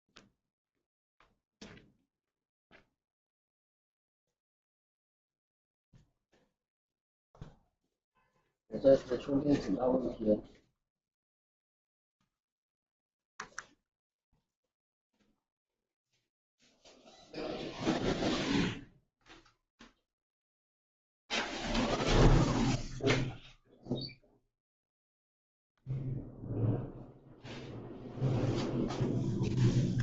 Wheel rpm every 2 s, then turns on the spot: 0, 0, 0, 0, 0, 0, 0, 0, 0, 0, 0, 0, 0, 0, 0.
none